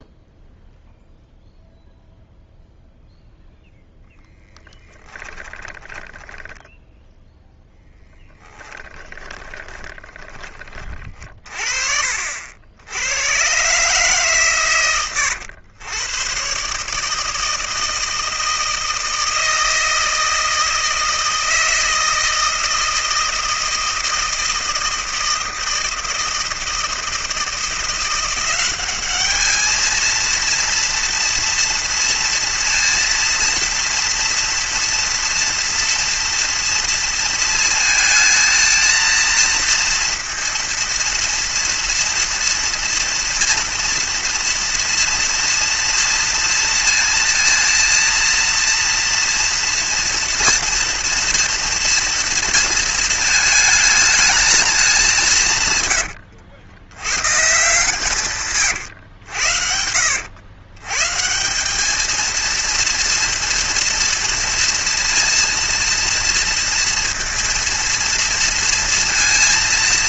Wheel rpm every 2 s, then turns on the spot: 0, 0, 10, 10, 10, 30, 80, 130, 140, 160, 160, 160, 160, 160, 190, 230, 230, 230, 230, 230, 230, 230, 230, 230, 230, 230, 230, 210, 100, 120, 120, 230, 230, 230, 230.
4-6 8-10